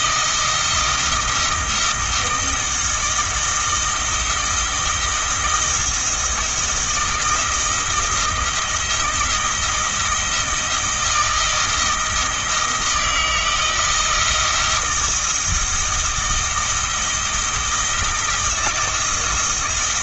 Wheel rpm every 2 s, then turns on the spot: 160, 170, 160, 170, 170, 160, 160, 160, 160, 160.
none